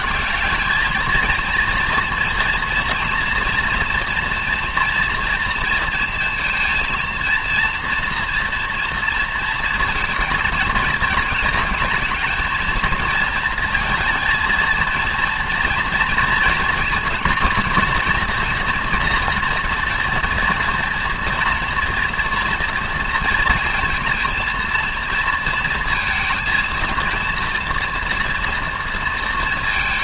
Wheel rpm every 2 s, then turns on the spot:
200, 230, 230, 230, 230, 220, 220, 230, 230, 230, 230, 230, 230, 230, 240.
none